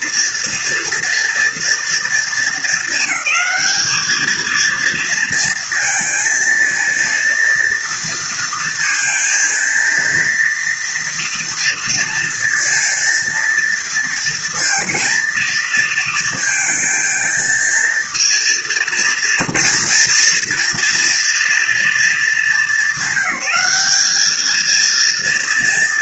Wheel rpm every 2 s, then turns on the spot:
230, 220, 220, 230, 230, 230, 230, 230, 220, 230, 230, 200, 220.
none